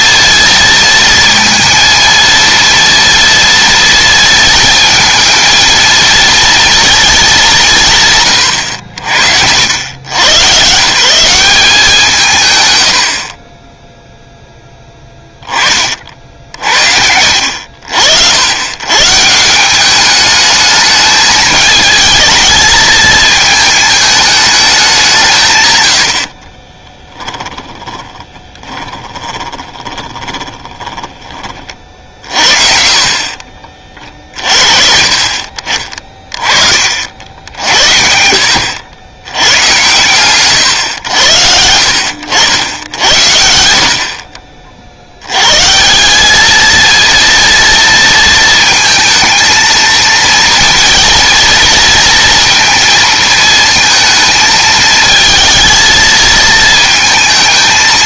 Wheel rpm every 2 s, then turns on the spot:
230, 230, 230, 230, 90, 140, 110, 10, 60, 120, 210, 220, 200, 30, 20, 20, 40, 50, 40, 80, 130, 80, 60, 220, 230, 230, 230, 220, 220.
26-32